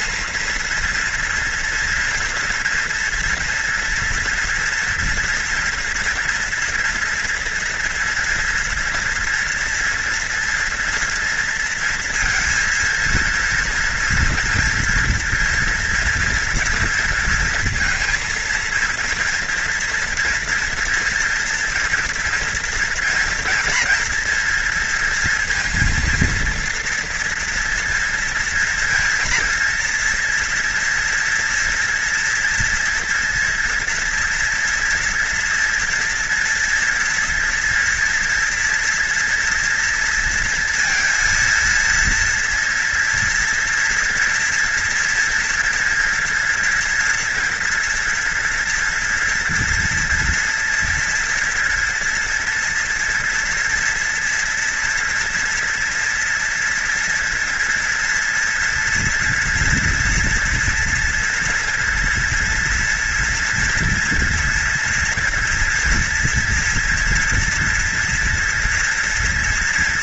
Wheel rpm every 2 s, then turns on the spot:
230, 230, 230, 230, 240, 230, 230, 230, 230, 230, 230, 230, 230, 230, 230, 230, 230, 230, 230, 230, 230, 230, 240, 240, 240, 230, 230, 230, 230, 230, 230, 230, 230, 230, 230.
none